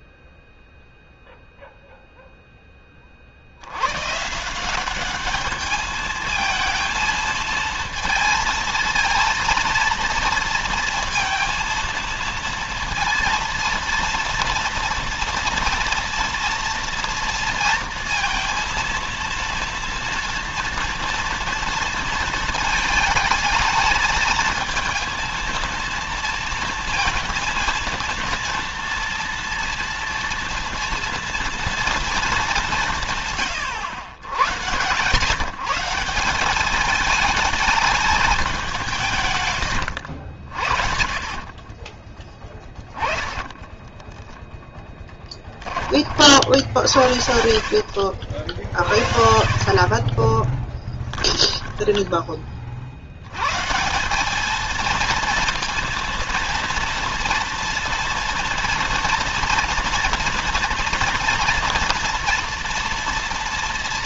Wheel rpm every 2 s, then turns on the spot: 0, 20, 190, 220, 230, 230, 230, 230, 230, 230, 230, 220, 230, 230, 230, 230, 160, 120, 210, 160, 60, 10, 10, 70, 50, 10, 60, 230, 230, 240, 230, 230.
40-44 50-52